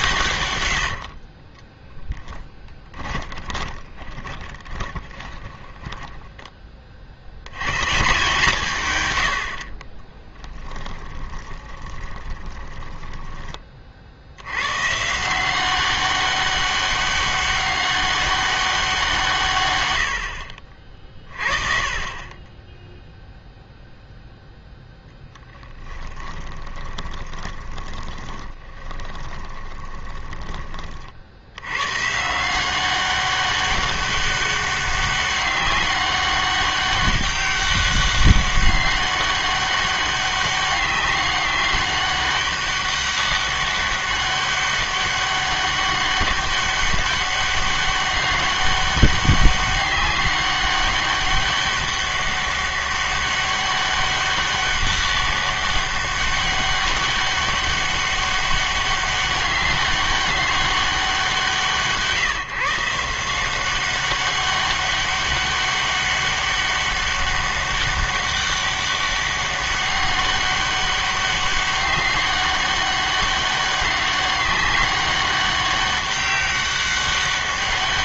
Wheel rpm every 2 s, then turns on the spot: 100, 10, 20, 20, 140, 10, 20, 110, 200, 190, 60, 10, 0, 20, 20, 30, 170, 200, 200, 200, 200, 200, 200, 190, 200, 200, 200, 200, 200, 200, 190, 150, 200, 200, 200, 200, 200, 200, 200.
0-6 10-14 26-30